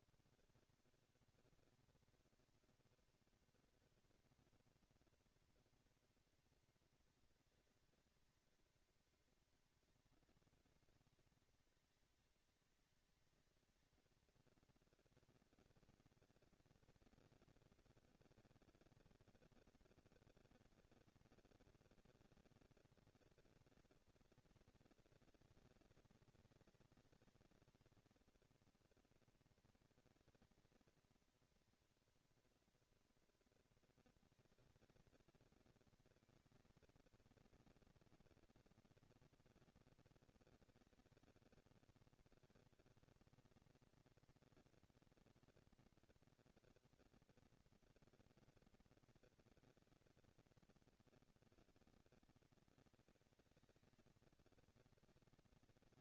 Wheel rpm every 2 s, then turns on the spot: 190, 230, 240, 230, 220, 210, 210, 230, 220, 220, 210, 220, 230, 220, 220, 220, 230, 230, 220, 230, 210, 140, 230, 230, 230, 150, 210, 200.
none